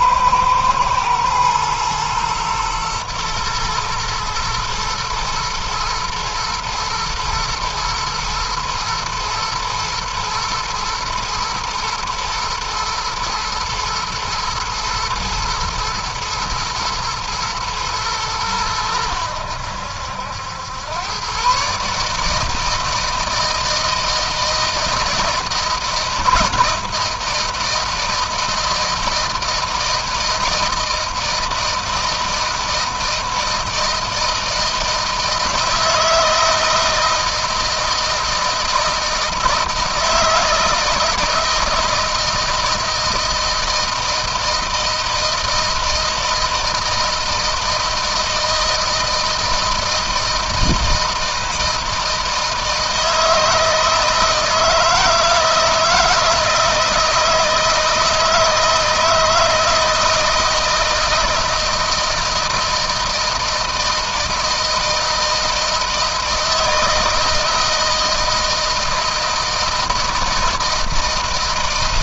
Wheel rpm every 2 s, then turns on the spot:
120, 120, 120, 110, 120, 120, 120, 120, 110, 100, 100, 160, 160, 160, 160, 160, 160, 160, 160, 160, 160, 160, 160, 160, 160, 160, 160, 160, 160, 160, 160, 160, 160, 160, 160, 160.
none